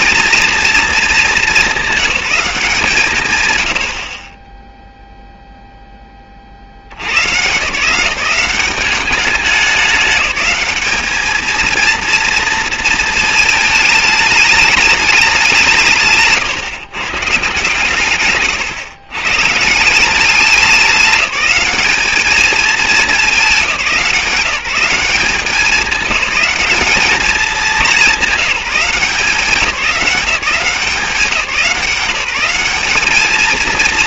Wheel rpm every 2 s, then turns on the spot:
230, 180, 20, 60, 190, 200, 230, 210, 150, 130, 190, 220, 180, 190, 190, 190, 200.
none